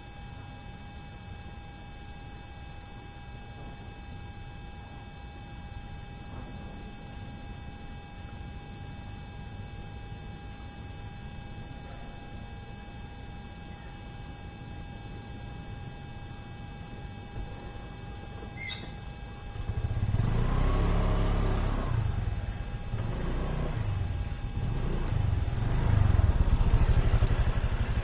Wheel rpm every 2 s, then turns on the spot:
0, 0, 0, 0, 0, 0, 0, 0, 0, 0, 0, 0, 0, 0.
none